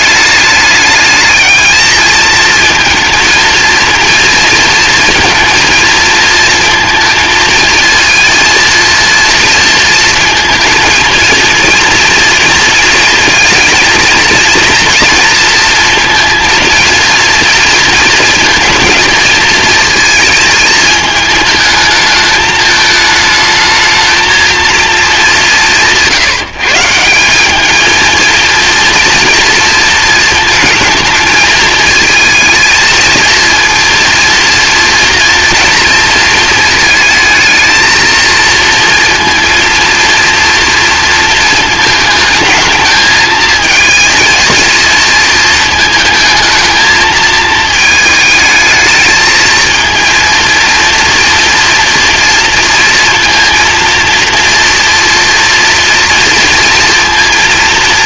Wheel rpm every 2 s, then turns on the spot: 210, 230, 230, 230, 230, 230, 230, 230, 230, 230, 220, 210, 220, 160, 230, 220, 220, 230, 230, 230, 230, 220, 220, 220, 220, 230, 230, 240, 230.
none